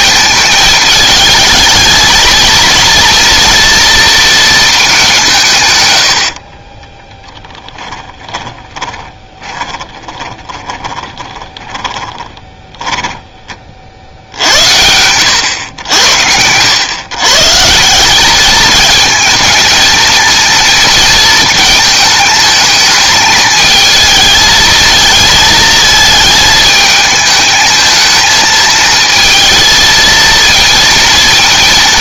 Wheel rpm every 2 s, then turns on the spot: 220, 230, 220, 30, 20, 20, 10, 80, 100, 220, 230, 220, 220, 220, 230, 230.
6-14